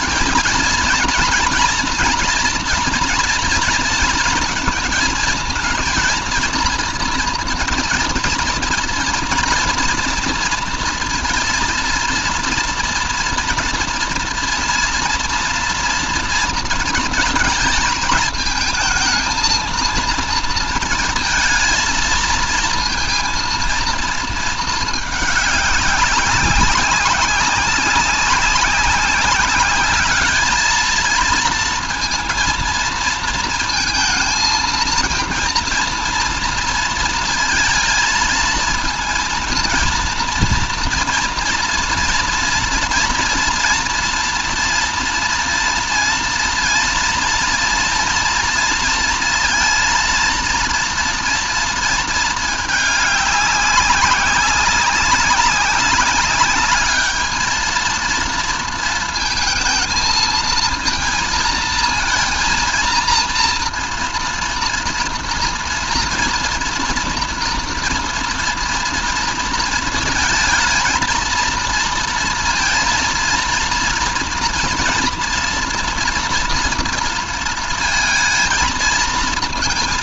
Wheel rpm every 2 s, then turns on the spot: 220, 240, 230, 230, 230, 230, 240, 240, 220, 230, 230, 230, 220, 190, 190, 220, 230, 230, 230, 230, 230, 230, 230, 230, 230, 230, 210, 190, 210, 230, 220, 230, 230, 230, 230, 220, 230, 230, 230, 230.
none